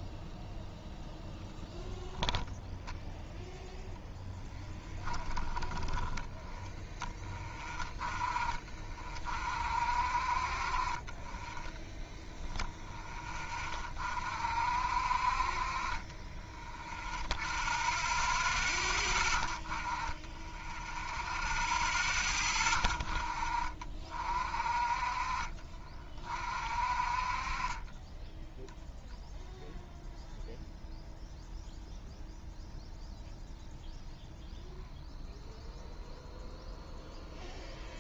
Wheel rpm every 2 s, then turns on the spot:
0, 10, 10, 10, 30, 40, 0, 50, 10, 10, 10, 20, 40, 40, 0, 0, 0, 0, 0.
2-6